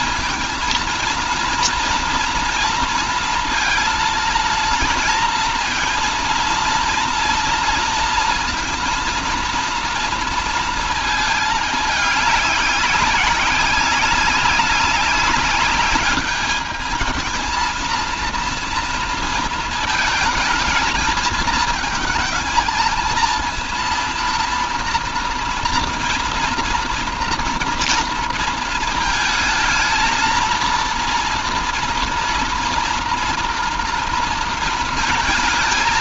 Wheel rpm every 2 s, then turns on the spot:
230, 230, 230, 230, 230, 230, 200, 190, 220, 230, 220, 220, 230, 230, 220, 230, 230, 230.
none